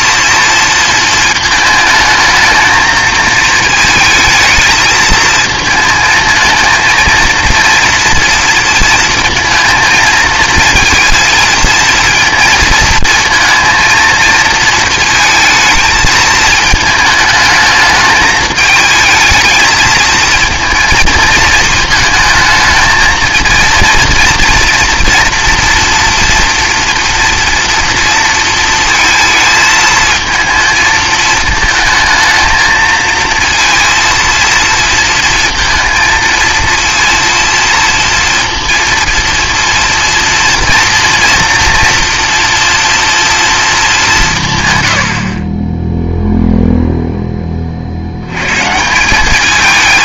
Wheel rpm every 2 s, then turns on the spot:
230, 220, 220, 220, 230, 220, 230, 230, 220, 220, 230, 220, 230, 230, 230, 220, 220, 230, 230, 230, 230, 230, 130, 0, 150.
none